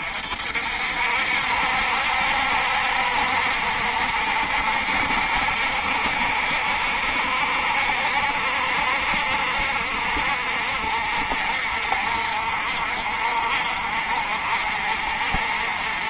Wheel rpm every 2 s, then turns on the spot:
60, 70, 60, 60, 60, 50, 50, 50.
none